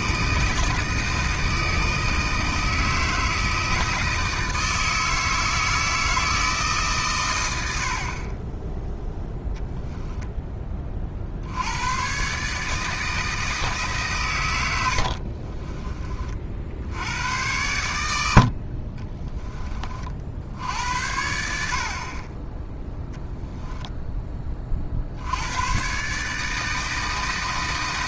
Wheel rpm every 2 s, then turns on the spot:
160, 160, 160, 150, 10, 20, 150, 100, 50, 60, 70, 10, 20, 150.
none